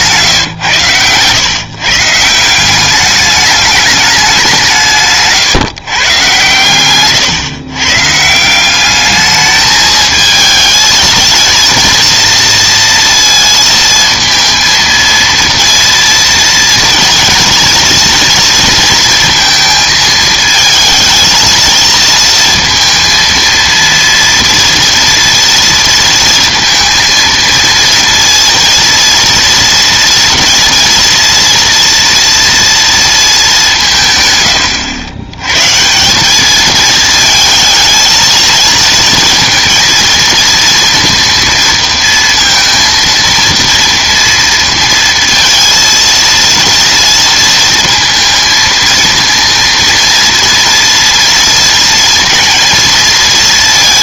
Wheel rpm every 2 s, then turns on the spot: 110, 190, 170, 120, 190, 220, 230, 230, 230, 230, 220, 230, 240, 230, 230, 230, 230, 110, 220, 230, 230, 230, 230, 230, 220, 230, 230.
none